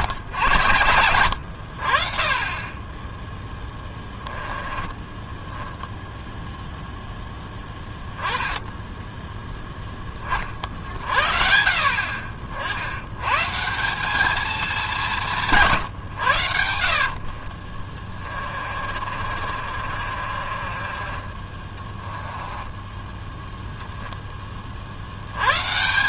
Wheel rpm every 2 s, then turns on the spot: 100, 10, 10, 0, 10, 60, 90, 200, 60, 40, 40, 10, 40.
2-6 16-24